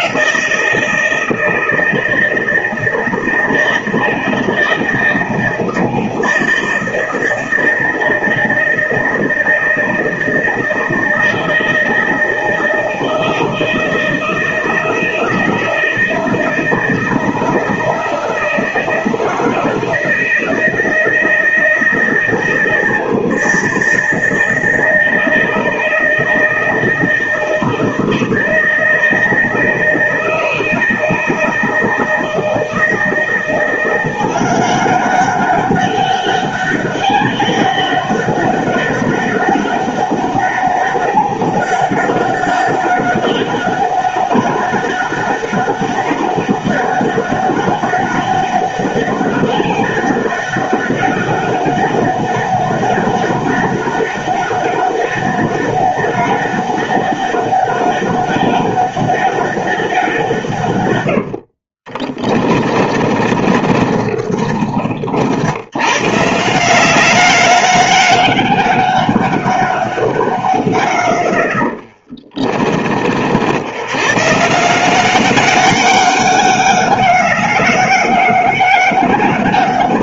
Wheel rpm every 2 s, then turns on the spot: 180, 160, 160, 160, 160, 160, 160, 160, 160, 160, 160, 160, 160, 160, 160, 160, 160, 180, 200, 200, 200, 200, 200, 200, 200, 200, 200, 200, 200, 200, 160, 30, 40, 150, 200, 120, 40, 140, 200, 200.
62-66 72-74